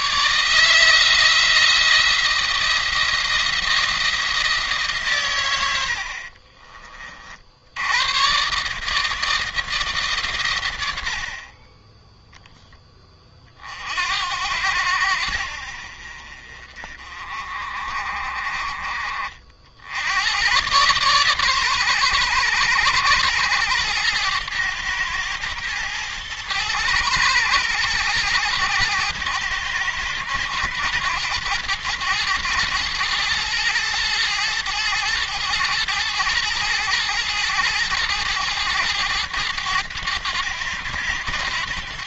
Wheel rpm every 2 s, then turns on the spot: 150, 170, 150, 30, 140, 100, 10, 80, 40, 40, 110, 110, 110, 110, 110, 110, 110, 110, 110, 110, 100.
none